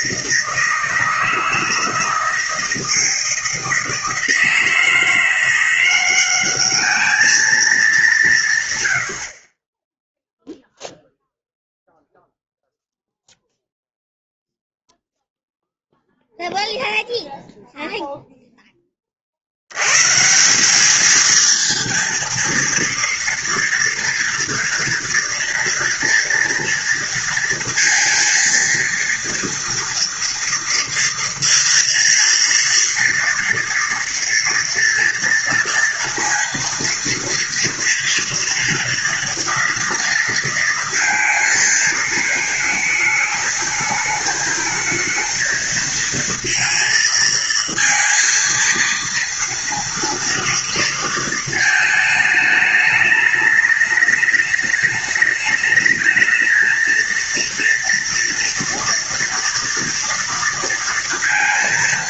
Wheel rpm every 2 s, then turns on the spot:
160, 160, 160, 200, 160, 0, 0, 0, 0, 0, 170, 230, 230, 230, 230, 230, 230, 230, 230, 230, 230, 220, 220, 230, 230, 230, 210, 210, 220, 240, 230.
none